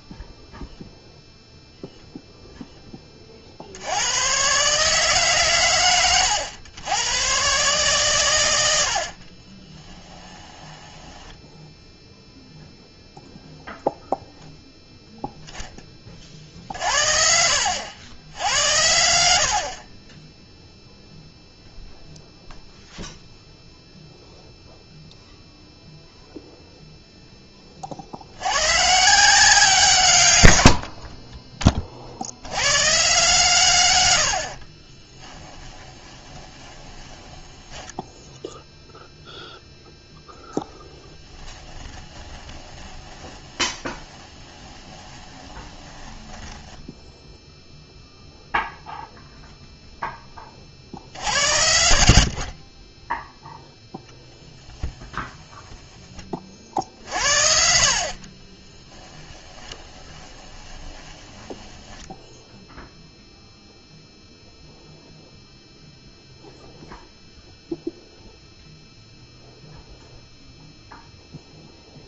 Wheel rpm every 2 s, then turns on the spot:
0, 20, 140, 110, 90, 10, 0, 0, 60, 80, 0, 0, 0, 0, 120, 70, 110, 40, 20, 0, 10, 20, 20, 10, 0, 50, 30, 10, 50, 20, 20, 0, 0, 0, 0, 0.
10-12 34-38 42-48 58-62